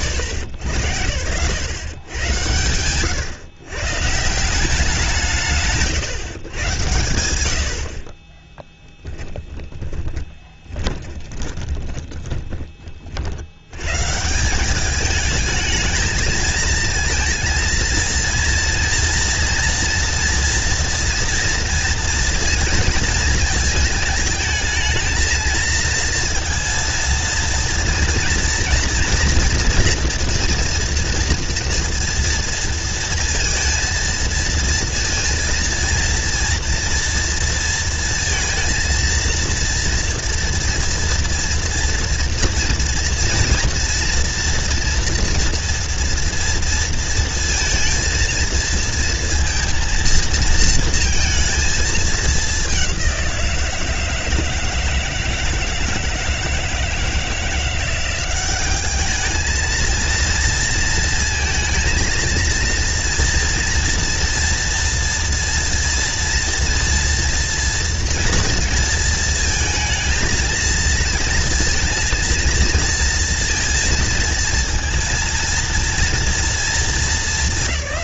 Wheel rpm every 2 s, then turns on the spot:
80, 110, 170, 110, 10, 20, 40, 200, 220, 230, 230, 230, 220, 230, 230, 230, 230, 230, 230, 230, 230, 230, 230, 230, 230, 230, 200, 160, 160, 200, 230, 230, 240, 230, 230, 230, 230, 230, 230.
8-12